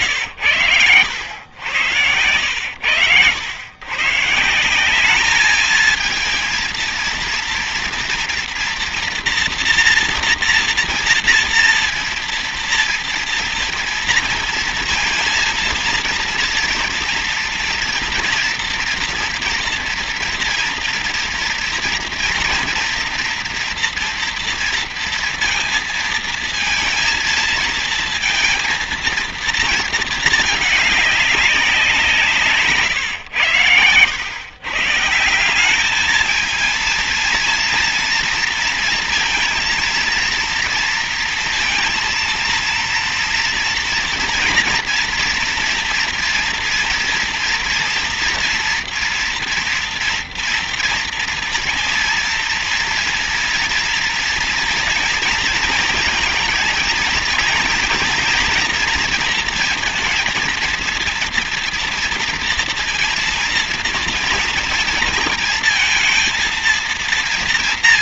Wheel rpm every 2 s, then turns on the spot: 110, 90, 180, 230, 230, 230, 230, 230, 230, 230, 230, 240, 230, 220, 230, 210, 140, 120, 220, 230, 240, 230, 230, 230, 230, 240, 230, 230, 220, 230, 230, 230, 230, 230.
none